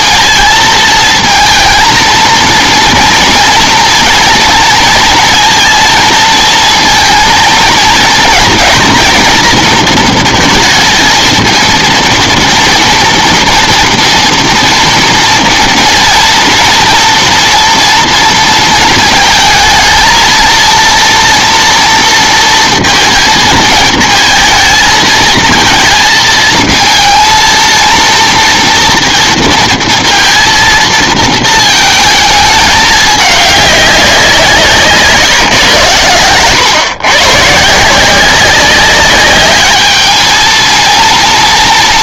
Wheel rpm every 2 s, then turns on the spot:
220, 230, 240, 230, 240, 220, 230, 230, 230, 230, 230, 230, 220, 230, 230, 230, 210, 170, 110, 190, 220.
none